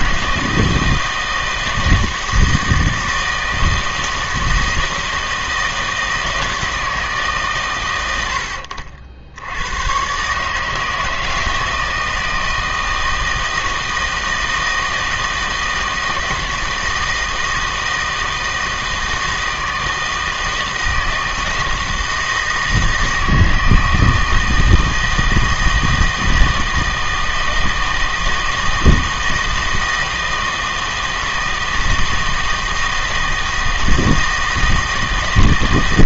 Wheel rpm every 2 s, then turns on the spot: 160, 160, 160, 160, 70, 150, 160, 160, 160, 160, 160, 160, 160, 160, 160, 160, 160, 160.
none